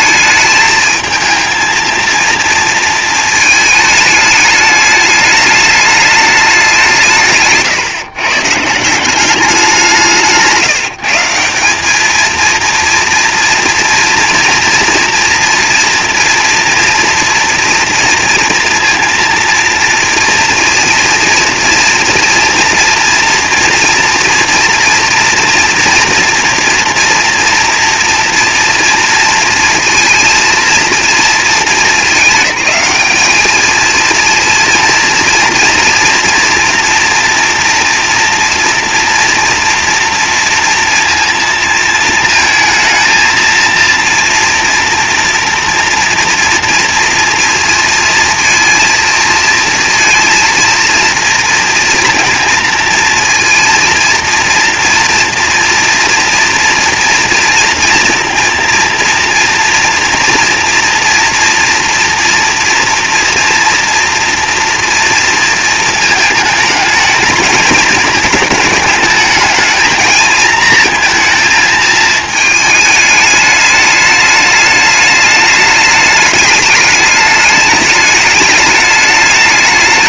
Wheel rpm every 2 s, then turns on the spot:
220, 230, 210, 180, 160, 160, 230, 240, 230, 230, 230, 230, 230, 230, 230, 230, 210, 230, 240, 230, 230, 220, 230, 230, 230, 230, 230, 230, 240, 230, 230, 230, 230, 220, 210, 230, 220, 210, 210, 210.
none